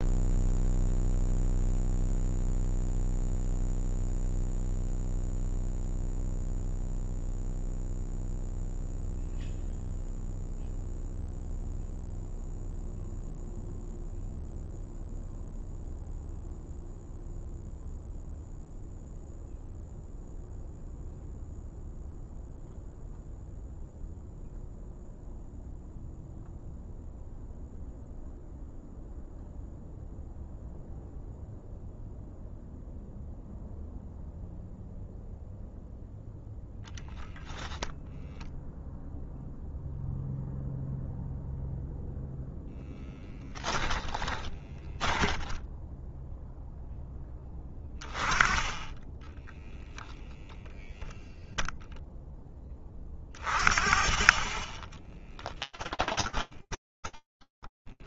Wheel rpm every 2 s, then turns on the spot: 0, 0, 0, 0, 0, 0, 0, 0, 0, 0, 0, 0, 0, 0, 0, 0, 0, 0, 0, 0, 0, 0, 20, 10, 20, 0, 20, 10, 10.
44-46 54-58